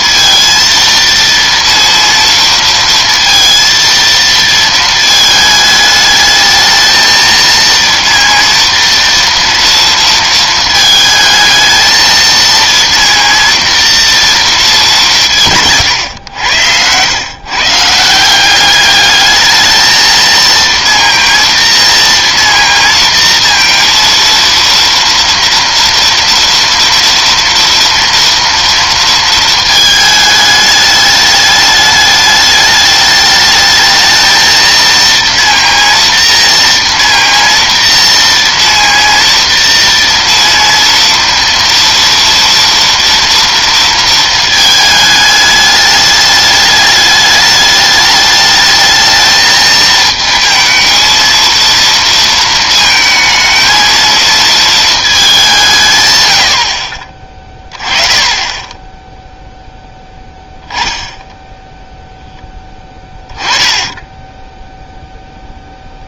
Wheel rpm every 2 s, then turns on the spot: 230, 230, 230, 220, 230, 220, 230, 210, 100, 190, 230, 230, 230, 230, 230, 210, 210, 220, 230, 230, 230, 230, 220, 210, 210, 220, 220, 220, 70, 10, 10, 10, 0.
none